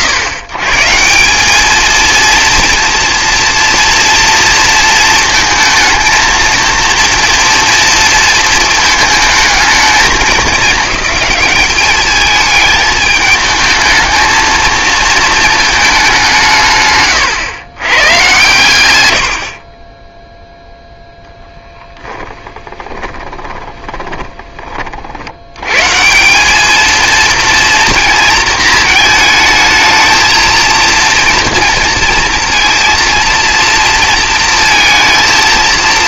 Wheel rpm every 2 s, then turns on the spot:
140, 230, 230, 230, 230, 200, 220, 220, 140, 100, 0, 10, 30, 210, 220, 230, 230, 230.
22-24